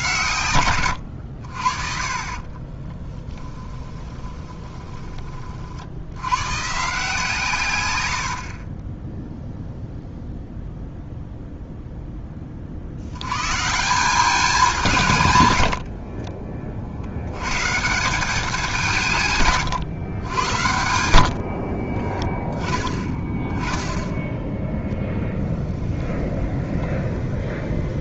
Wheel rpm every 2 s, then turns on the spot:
110, 20, 20, 140, 20, 0, 40, 180, 40, 180, 100, 20, 10, 20.
2-6 8-10 20-22 26-28